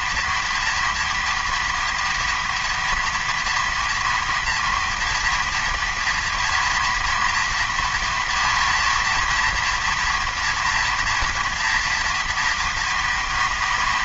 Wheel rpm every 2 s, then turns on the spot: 230, 230, 240, 230, 230, 230, 230.
none